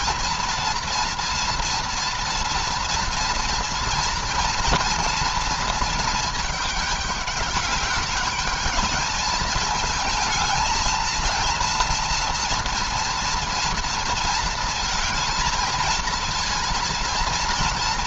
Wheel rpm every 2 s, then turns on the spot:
230, 230, 230, 210, 210, 220, 230, 220, 230.
none